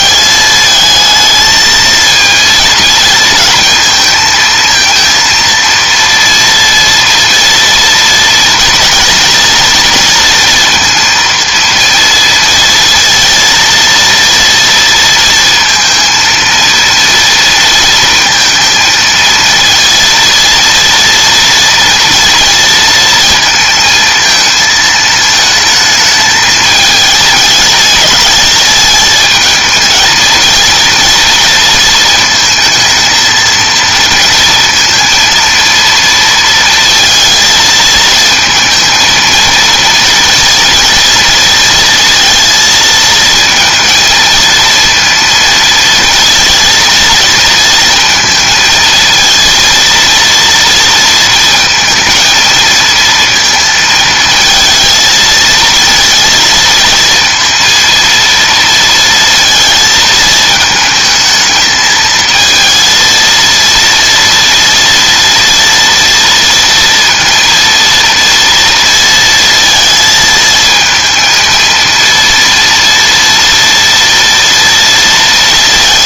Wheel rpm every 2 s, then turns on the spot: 220, 230, 220, 230, 230, 230, 230, 230, 230, 230, 230, 230, 220, 220, 210, 230, 220, 230, 230, 220, 230, 230, 230, 230, 220, 230, 230, 220, 230, 230, 220, 230, 230, 230, 230, 220, 230, 230.
none